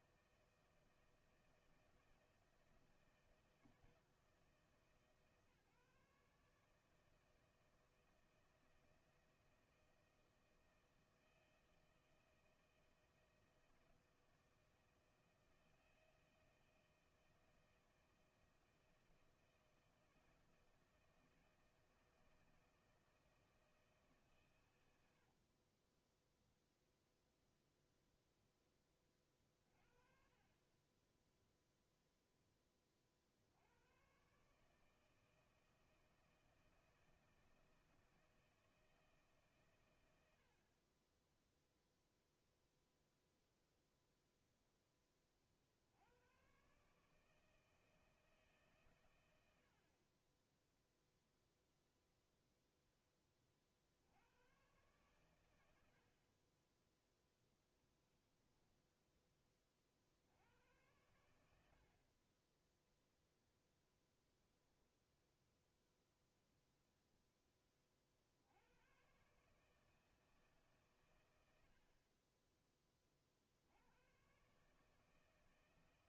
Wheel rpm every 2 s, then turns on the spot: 160, 160, 150, 150, 170, 160, 160, 160, 160, 160, 160, 160, 120, 0, 10, 40, 10, 140, 160, 160, 70, 0, 0, 120, 150, 20, 0, 110, 30, 10, 90, 20, 0, 0, 80, 150, 20, 130.
58-60